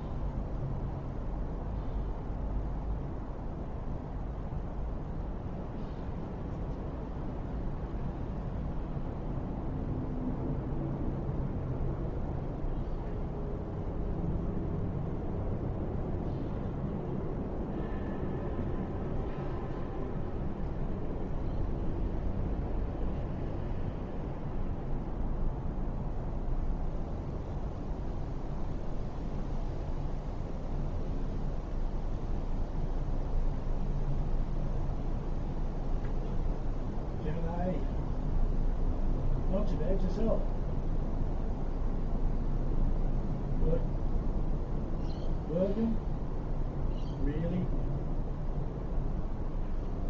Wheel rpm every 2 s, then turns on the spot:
0, 0, 0, 0, 0, 0, 0, 0, 0, 0, 0, 0, 0, 0, 0, 0, 0, 0, 0, 0, 0, 0, 0, 0, 0.
none